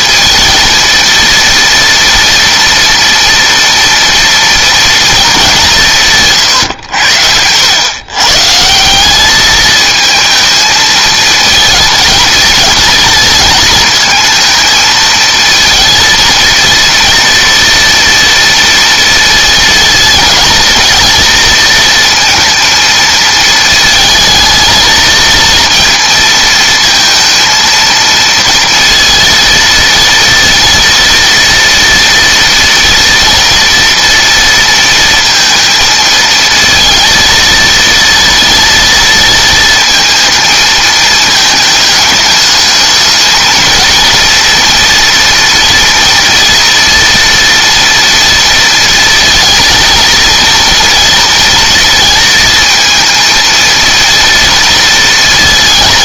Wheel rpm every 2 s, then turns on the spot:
230, 230, 240, 110, 160, 220, 220, 220, 230, 230, 230, 230, 220, 230, 230, 230, 230, 230, 230, 230, 220, 210, 230, 230, 230, 230, 230, 230.
none